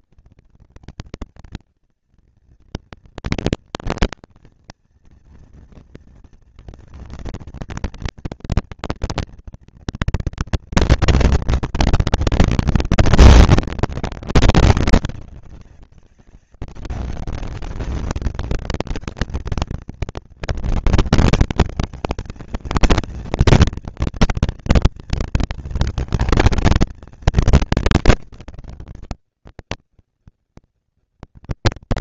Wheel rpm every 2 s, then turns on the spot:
230, 230, 230, 230, 230, 240, 230, 200, 200, 220, 220, 220, 230, 220, 220, 230.
none